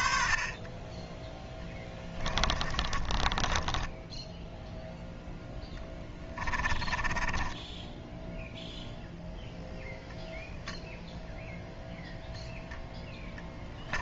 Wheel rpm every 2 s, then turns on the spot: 40, 20, 10, 20, 0, 0, 10.
2-4 6-8